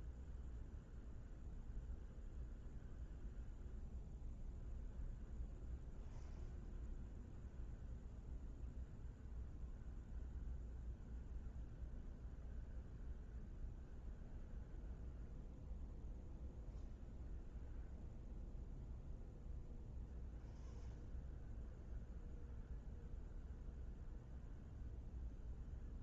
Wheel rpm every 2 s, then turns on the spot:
0, 0, 0, 0, 0, 0, 0, 0, 0, 0, 0, 0, 0.
none